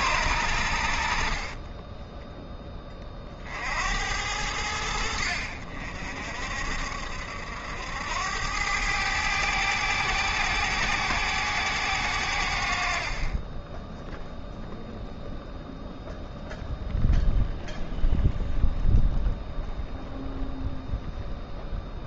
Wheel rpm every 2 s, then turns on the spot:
80, 10, 90, 60, 90, 110, 70, 0, 0, 0, 0.
none